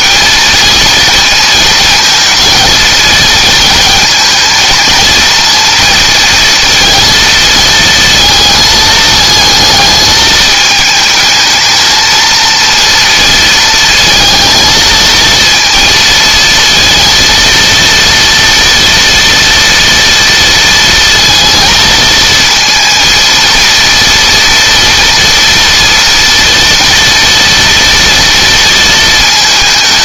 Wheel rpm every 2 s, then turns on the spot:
230, 230, 230, 230, 220, 220, 230, 220, 230, 230, 230, 230, 230, 230, 230.
none